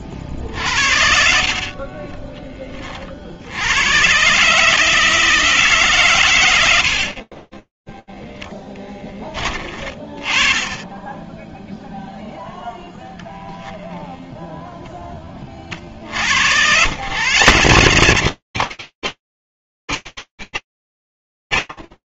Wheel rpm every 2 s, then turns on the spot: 40, 30, 140, 90, 10, 20, 0, 0, 90, 180, 150.
none